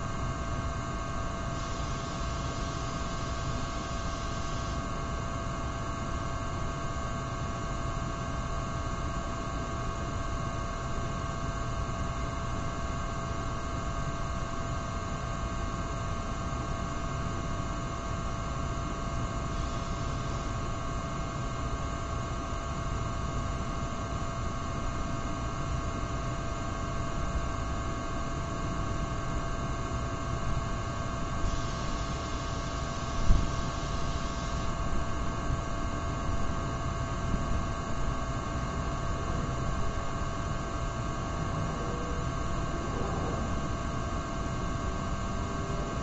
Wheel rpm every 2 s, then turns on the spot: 0, 0, 0, 0, 0, 0, 0, 0, 0, 0, 0, 0, 0, 0, 0, 0, 0, 0, 0, 0, 0, 0, 0.
none